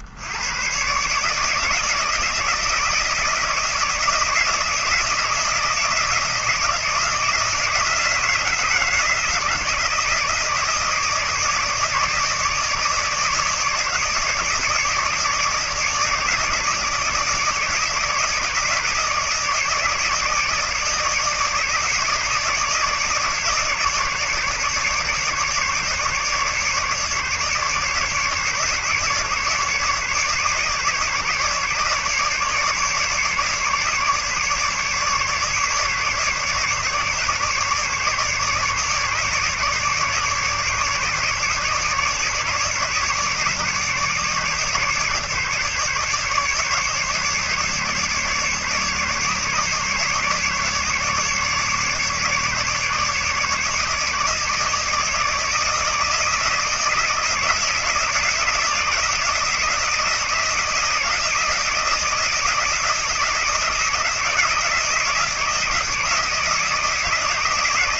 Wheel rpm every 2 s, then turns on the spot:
70, 160, 160, 160, 170, 160, 150, 160, 150, 150, 150, 160, 150, 150, 150, 150, 150, 150, 150, 150, 150, 150, 150, 150, 150, 150, 150, 160, 160, 160, 160, 160, 160, 160.
none